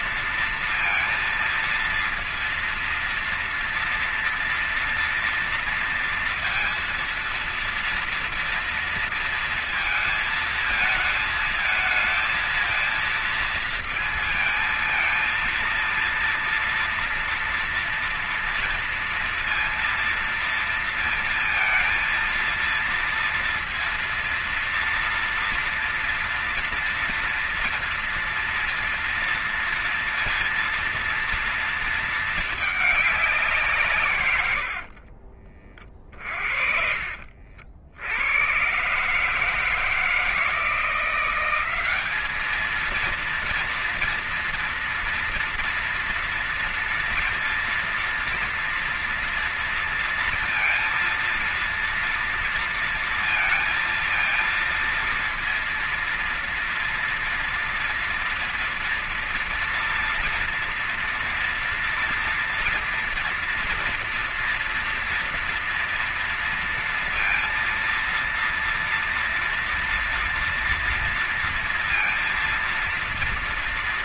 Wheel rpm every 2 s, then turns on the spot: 230, 230, 230, 230, 230, 220, 220, 220, 230, 230, 230, 230, 230, 230, 230, 230, 220, 140, 50, 90, 160, 210, 230, 230, 230, 230, 230, 230, 230, 230, 240, 230, 230, 230, 230, 230, 230.
none